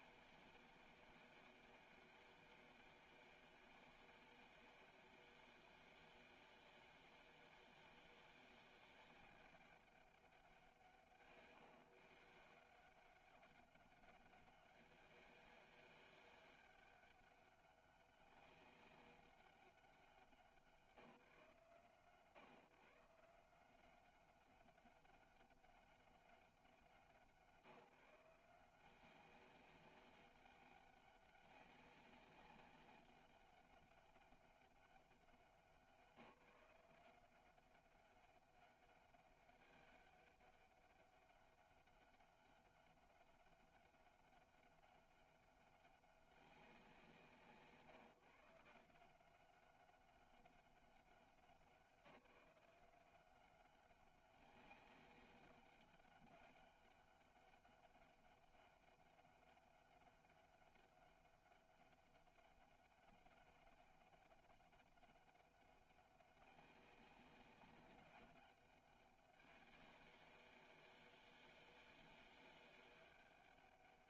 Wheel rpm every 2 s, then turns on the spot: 190, 200, 190, 190, 200, 170, 160, 200, 200, 200, 170, 140, 200, 190, 170, 200, 200, 200, 180, 200, 200, 200, 200, 180, 160, 200, 180, 200, 200, 200, 200, 200, 200, 200, 200, 190, 190.
none